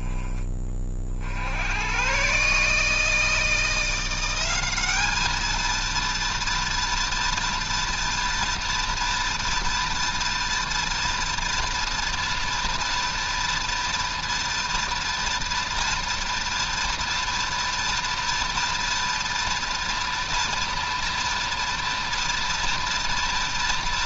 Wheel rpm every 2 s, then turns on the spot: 30, 150, 200, 240, 230, 230, 240, 230, 230, 230, 230, 230.
none